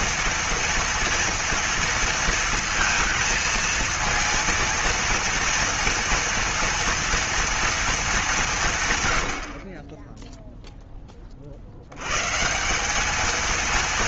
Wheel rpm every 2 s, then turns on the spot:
230, 230, 230, 230, 160, 10, 170.
none